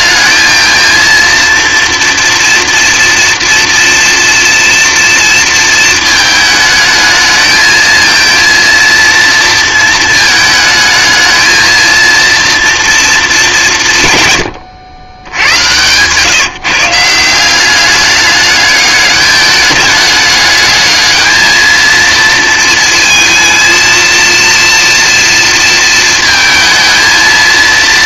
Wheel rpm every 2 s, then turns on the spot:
220, 230, 230, 220, 230, 220, 230, 100, 150, 210, 210, 230, 230, 220.
none